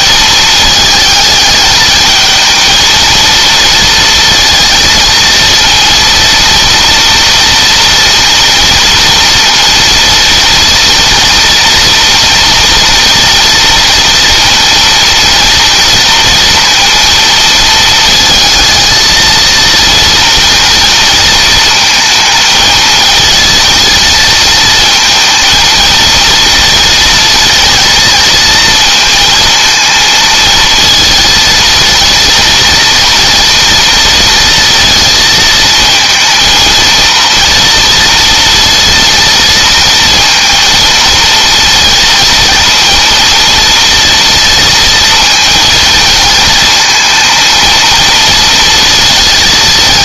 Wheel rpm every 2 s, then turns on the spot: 220, 220, 230, 230, 230, 230, 230, 230, 230, 220, 230, 220, 230, 230, 220, 230, 230, 230, 230, 230, 230, 230, 230, 230, 230.
none